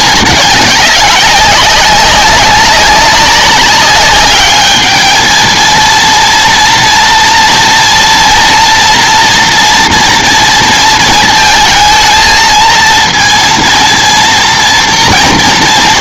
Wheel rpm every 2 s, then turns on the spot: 200, 190, 210, 230, 230, 230, 230, 230.
none